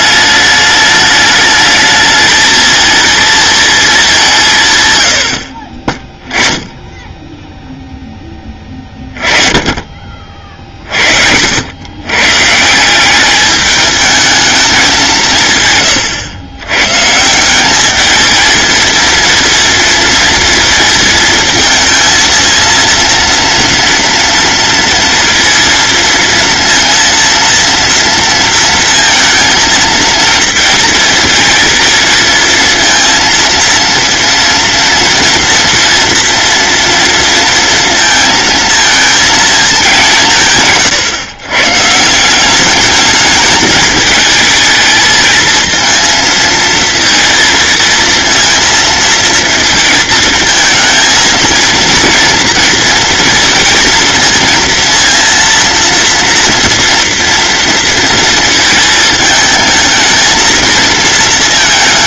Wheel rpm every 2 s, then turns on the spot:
210, 220, 130, 10, 20, 50, 170, 200, 120, 230, 230, 230, 230, 230, 230, 230, 230, 230, 230, 220, 140, 200, 220, 230, 230, 220, 230, 230, 230, 230, 220.
none